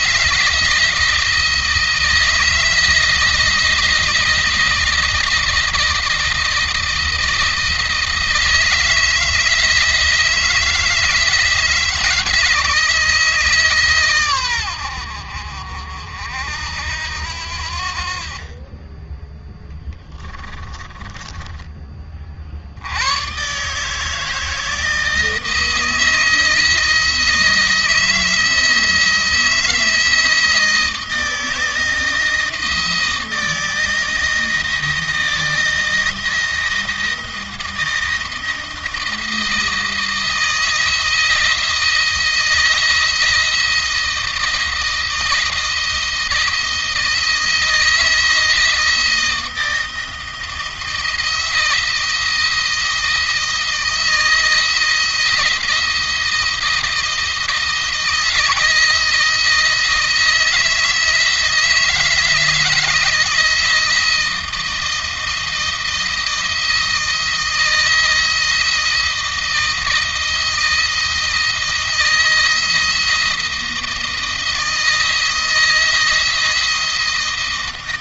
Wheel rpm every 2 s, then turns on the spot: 160, 160, 160, 160, 160, 160, 160, 100, 70, 30, 20, 70, 160, 160, 160, 160, 160, 160, 170, 160, 160, 160, 160, 160, 160, 170, 170, 160, 160, 160, 160, 160, 170, 160, 160, 160, 160, 160, 160.
20-22